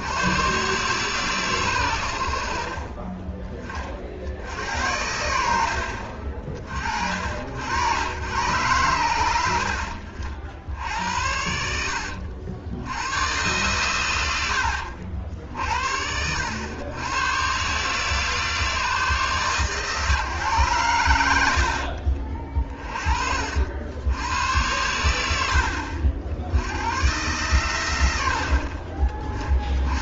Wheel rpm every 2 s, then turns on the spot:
130, 40, 80, 50, 100, 70, 90, 70, 100, 150, 110, 30, 90, 90, 40.
none